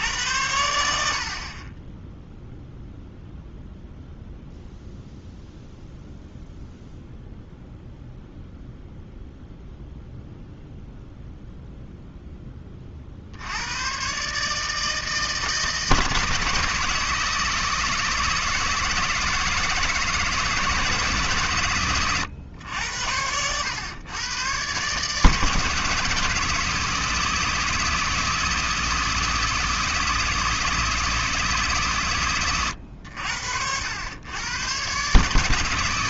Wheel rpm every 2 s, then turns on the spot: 80, 0, 0, 0, 0, 0, 30, 150, 160, 160, 160, 90, 130, 160, 160, 160, 100, 120.
none